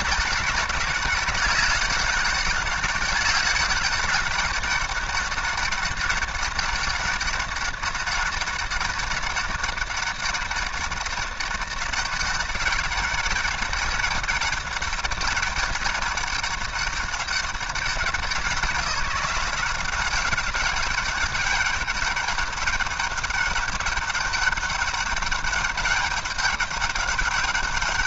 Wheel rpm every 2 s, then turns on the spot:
200, 200, 200, 200, 200, 200, 200, 200, 200, 170, 200, 200, 200, 200.
none